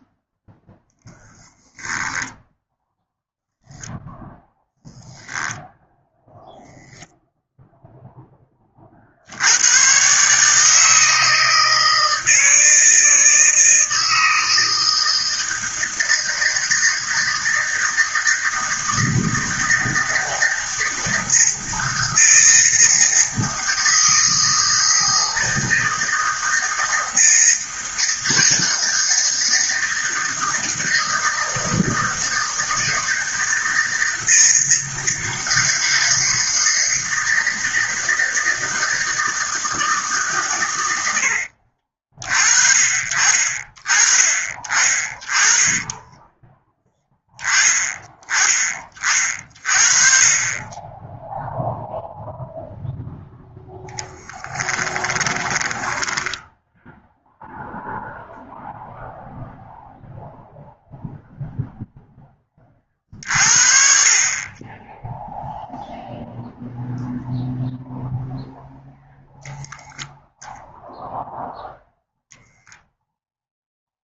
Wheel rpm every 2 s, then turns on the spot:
10, 10, 0, 0, 70, 160, 160, 160, 160, 160, 160, 160, 160, 160, 160, 160, 160, 160, 160, 160, 100, 50, 40, 10, 20, 10, 0, 10, 0, 0, 0, 40, 10, 0, 0, 0, 0.
54-56